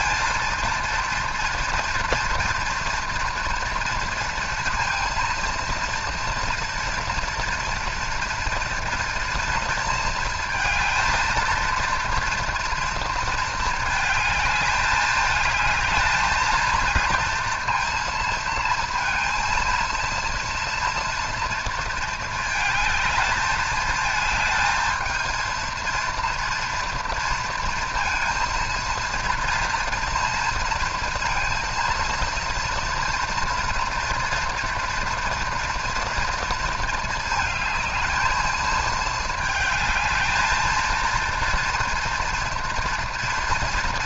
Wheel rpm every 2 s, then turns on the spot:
230, 230, 230, 230, 230, 230, 230, 210, 230, 230, 230, 220, 220, 230, 230, 230, 240, 230, 230, 220, 220, 230.
none